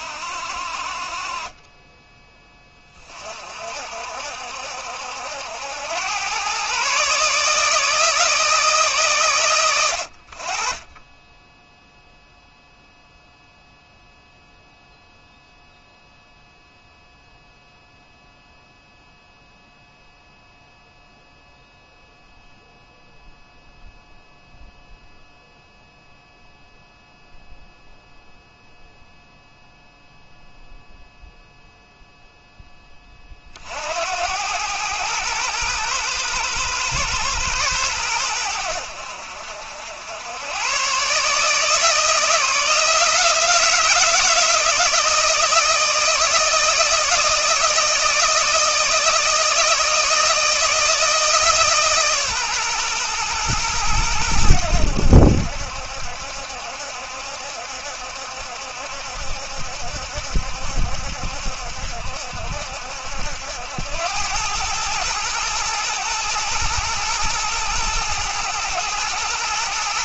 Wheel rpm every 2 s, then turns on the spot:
40, 30, 70, 140, 140, 20, 0, 0, 0, 0, 0, 0, 0, 0, 0, 0, 30, 110, 110, 70, 130, 160, 160, 160, 160, 160, 120, 80, 70, 70, 70, 70, 110, 120, 120.
none